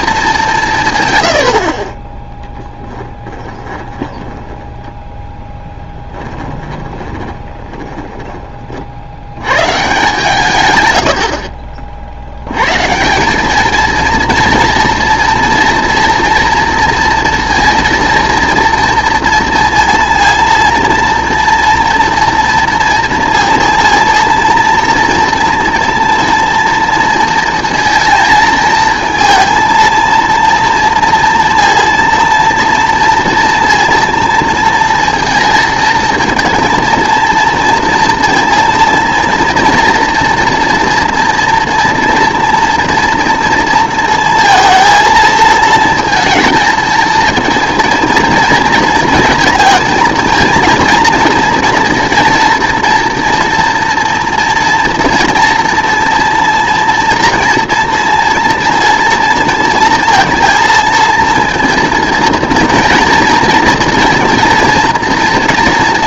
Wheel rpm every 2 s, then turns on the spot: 150, 10, 20, 30, 40, 120, 140, 230, 230, 230, 230, 230, 230, 230, 230, 230, 230, 230, 230, 230, 230, 230, 230, 230, 230, 230, 230, 240, 240, 230, 230, 230, 230.
2-8